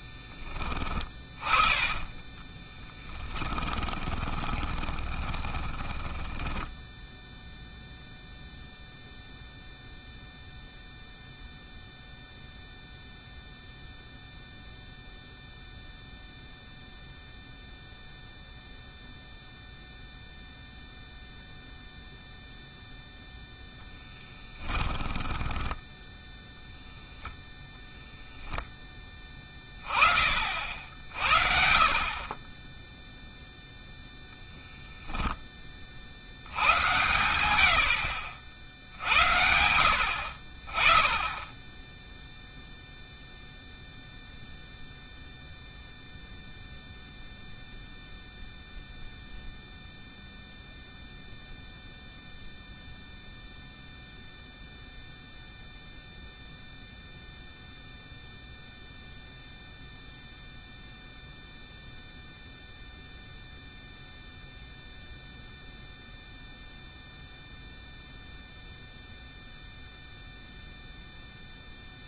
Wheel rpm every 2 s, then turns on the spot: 20, 20, 20, 10, 0, 0, 0, 0, 0, 0, 0, 0, 10, 0, 10, 60, 20, 10, 90, 40, 30, 0, 0, 0, 0, 0, 0, 0, 0, 0, 0, 0, 0, 0, 0, 0.
0-8 24-26